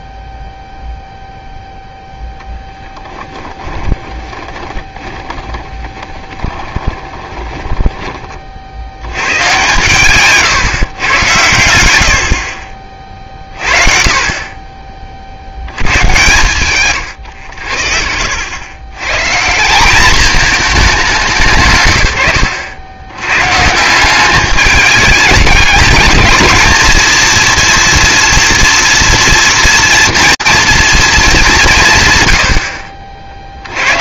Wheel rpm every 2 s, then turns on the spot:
0, 10, 20, 20, 60, 140, 40, 30, 120, 100, 210, 90, 200, 210, 230, 230, 60.
2-8